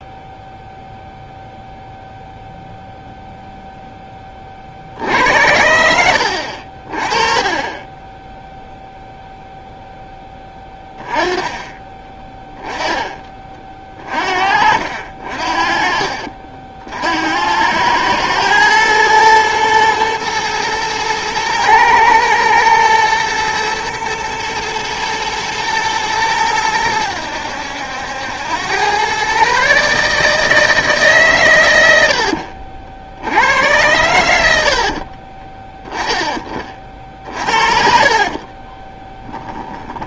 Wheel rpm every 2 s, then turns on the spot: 0, 0, 30, 50, 0, 10, 10, 50, 60, 110, 110, 110, 120, 110, 90, 160, 60, 70, 30, 40.
12-16 38-40